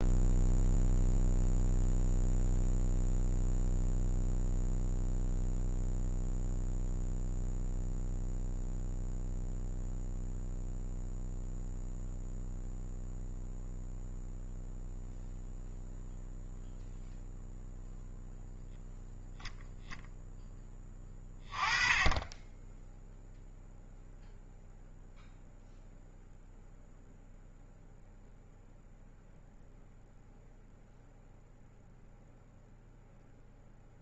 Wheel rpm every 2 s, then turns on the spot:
0, 0, 0, 0, 0, 0, 0, 0, 0, 0, 20, 0, 0, 0, 0, 0, 0.
none